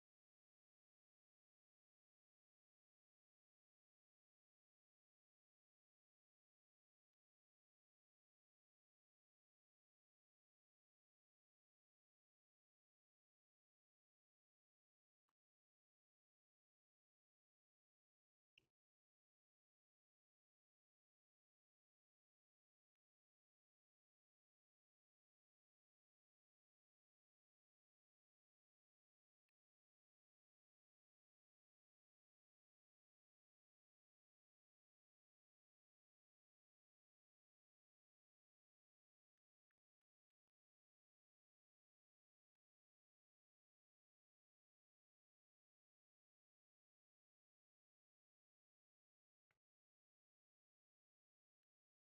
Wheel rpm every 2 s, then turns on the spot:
0, 0, 0, 0, 0, 0, 0, 0, 0, 0, 0, 0, 0, 0, 0, 0, 0, 0, 0, 0, 0, 0, 0, 0, 0, 0.
none